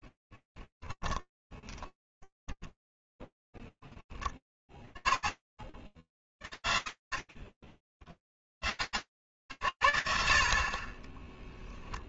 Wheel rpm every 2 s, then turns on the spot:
10, 10, 20, 50, 70, 30.
0-2